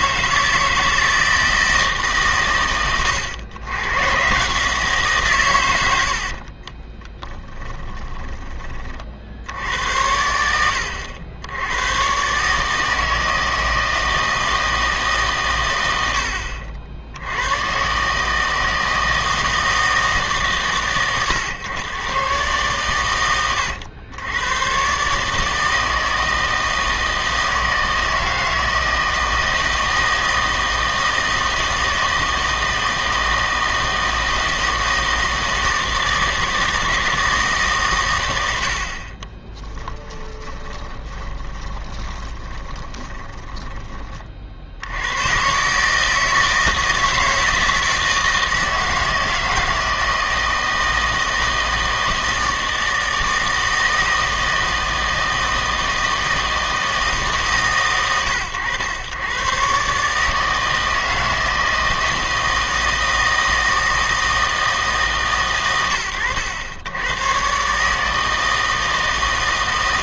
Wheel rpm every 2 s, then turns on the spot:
160, 120, 160, 30, 30, 80, 150, 160, 70, 160, 130, 120, 120, 160, 160, 160, 160, 160, 160, 70, 20, 10, 70, 160, 160, 160, 160, 160, 160, 110, 160, 160, 160, 100, 160.
6-8 40-44